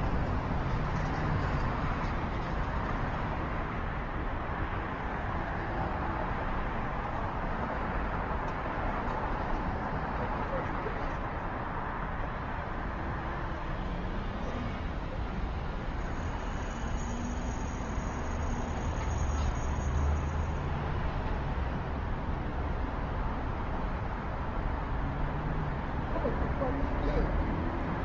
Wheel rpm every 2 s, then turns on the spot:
0, 0, 0, 0, 0, 0, 0, 0, 0, 0, 0, 0, 0, 0.
none